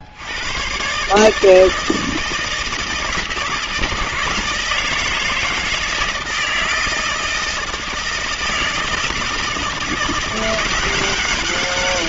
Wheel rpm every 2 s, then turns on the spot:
120, 160, 160, 160, 160, 180.
none